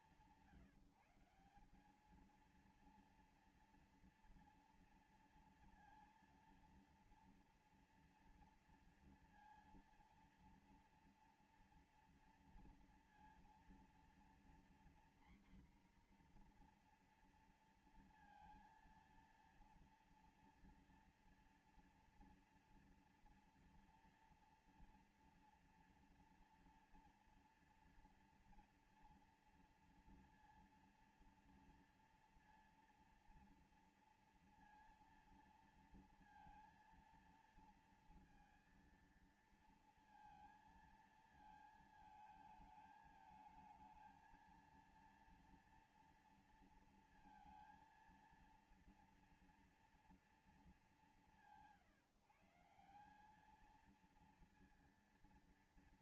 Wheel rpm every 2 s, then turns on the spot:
170, 220, 230, 230, 230, 230, 230, 240, 250, 230, 230, 230, 240, 230, 230, 230, 230, 230, 230, 230, 230, 220, 220, 230, 230, 210, 170, 230.
none